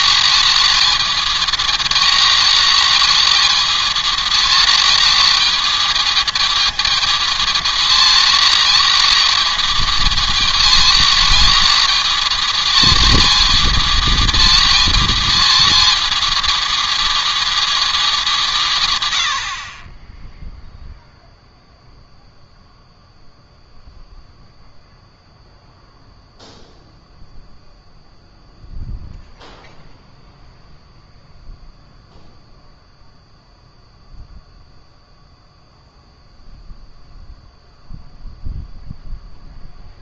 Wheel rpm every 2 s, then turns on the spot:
220, 220, 220, 220, 220, 220, 220, 220, 230, 170, 0, 0, 0, 0, 0, 0, 0, 0, 0, 0.
none